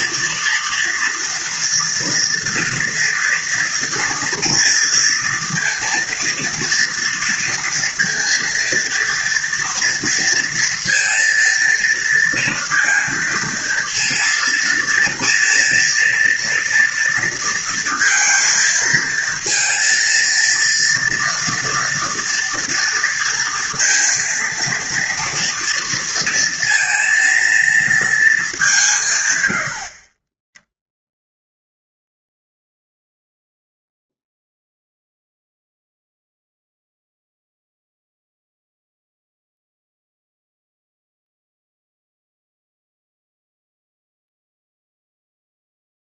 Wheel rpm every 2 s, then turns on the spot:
230, 240, 240, 230, 230, 230, 230, 230, 230, 230, 230, 230, 230, 230, 160, 0, 0, 0, 0, 0, 0, 0, 0.
none